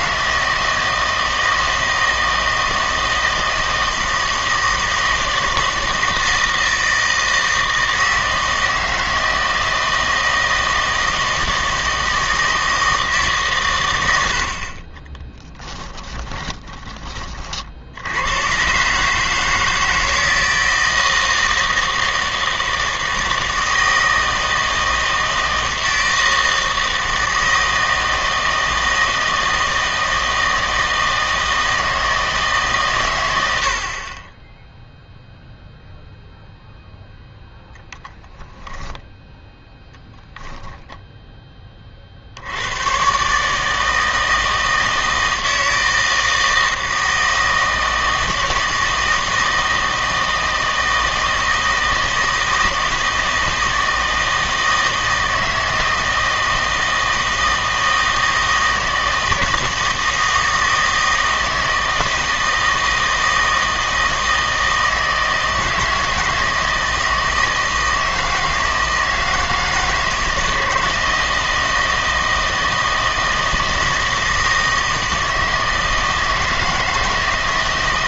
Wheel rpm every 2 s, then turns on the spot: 160, 160, 160, 160, 160, 160, 160, 40, 20, 120, 160, 160, 160, 160, 160, 160, 140, 0, 0, 0, 10, 100, 160, 160, 160, 160, 160, 160, 160, 160, 160, 160, 160, 160, 160, 160, 160, 160, 160.
40-42